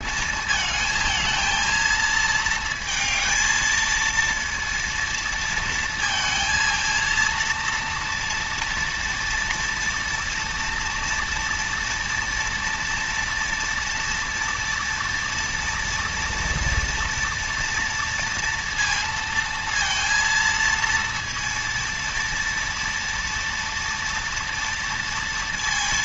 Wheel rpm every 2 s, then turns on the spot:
220, 220, 230, 230, 230, 230, 240, 230, 230, 230, 230, 230, 230.
none